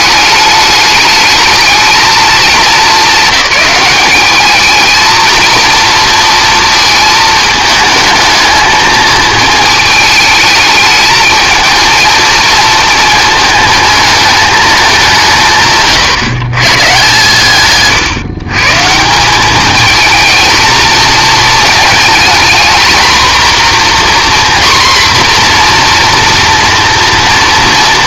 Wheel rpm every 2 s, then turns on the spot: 210, 210, 210, 220, 220, 210, 220, 210, 150, 150, 220, 230, 250, 230.
none